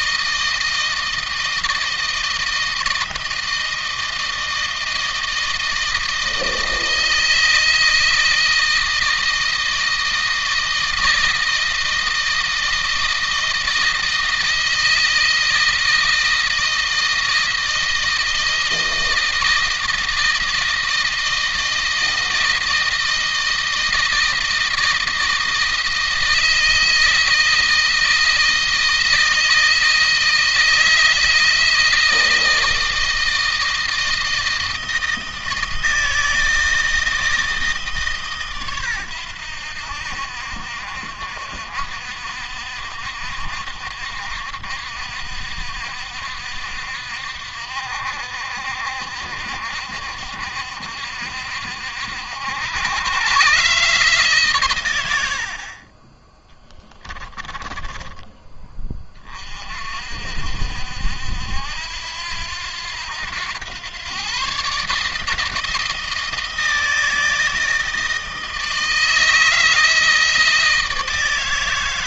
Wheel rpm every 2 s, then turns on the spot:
160, 170, 160, 160, 160, 160, 160, 160, 160, 160, 160, 160, 160, 160, 160, 160, 160, 160, 160, 110, 60, 60, 60, 60, 60, 60, 100, 110, 10, 30, 70, 90, 150, 160, 160, 160.
56-58